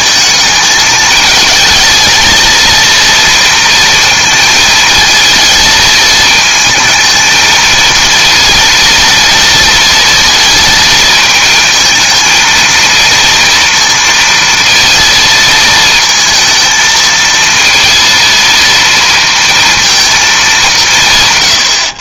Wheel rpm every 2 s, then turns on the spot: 220, 230, 220, 220, 230, 230, 220, 230, 220, 230, 190.
none